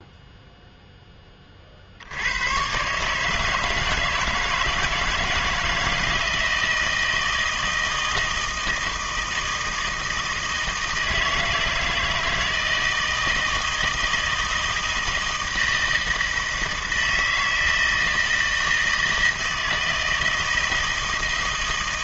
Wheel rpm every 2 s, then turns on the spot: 0, 110, 160, 160, 160, 160, 160, 160, 160, 160, 160.
none